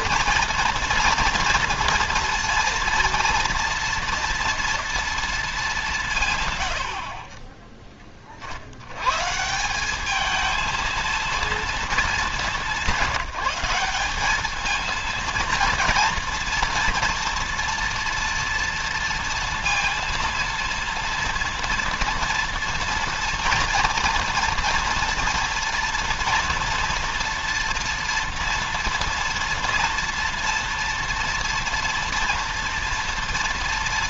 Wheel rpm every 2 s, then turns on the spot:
230, 230, 230, 80, 100, 230, 190, 220, 230, 230, 230, 230, 230, 240, 230, 230, 230.
none